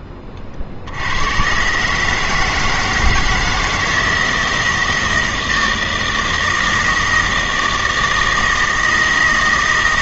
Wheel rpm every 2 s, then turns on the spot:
40, 160, 160, 160, 160.
none